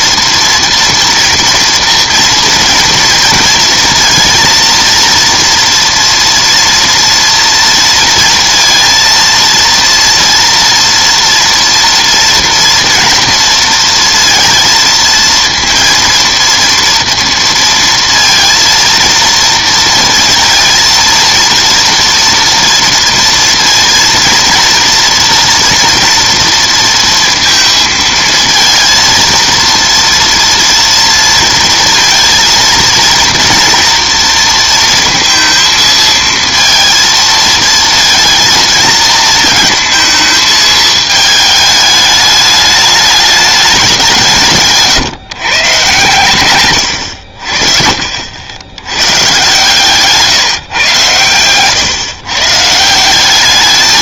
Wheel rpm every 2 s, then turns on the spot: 230, 230, 230, 230, 230, 230, 230, 230, 230, 230, 230, 230, 230, 230, 230, 230, 230, 230, 230, 230, 220, 210, 150, 90, 110, 140, 160.
44-46